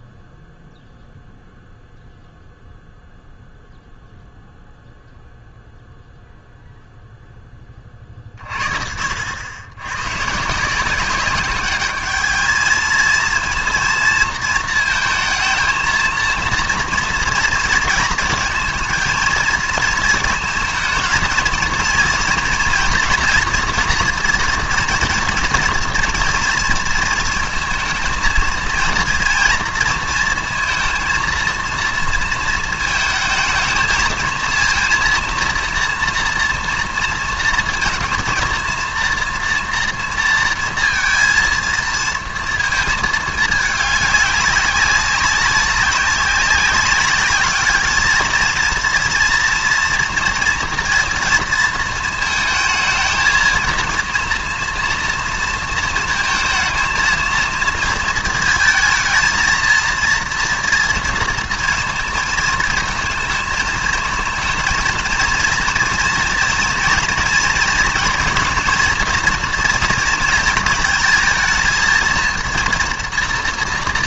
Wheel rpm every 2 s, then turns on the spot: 0, 0, 0, 0, 50, 160, 220, 230, 230, 230, 230, 240, 240, 230, 230, 230, 220, 230, 230, 230, 230, 230, 200, 200, 230, 230, 220, 240, 230, 220, 230, 230, 230, 240, 230, 220, 230.
none